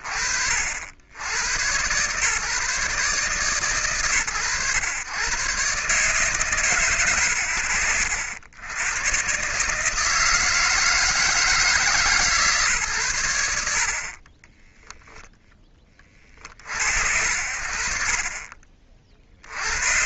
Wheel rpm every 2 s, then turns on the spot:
80, 140, 120, 100, 130, 150, 100, 10, 60, 60.
none